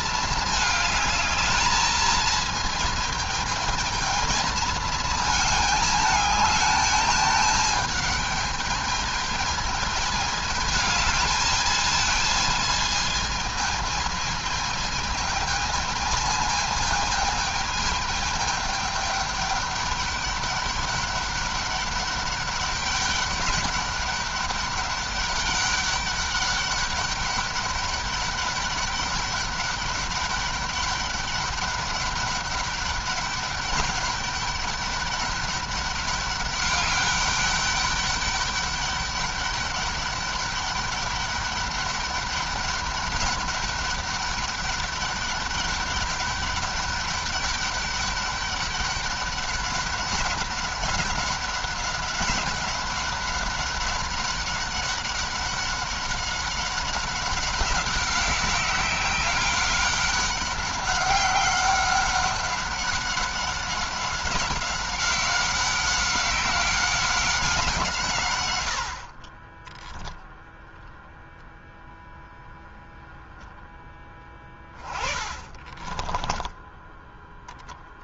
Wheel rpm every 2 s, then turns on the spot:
210, 220, 220, 210, 220, 210, 220, 220, 220, 210, 200, 200, 200, 200, 200, 200, 200, 200, 200, 200, 200, 200, 200, 200, 200, 190, 200, 190, 190, 190, 200, 190, 190, 190, 50, 0, 0, 20, 10.
74-78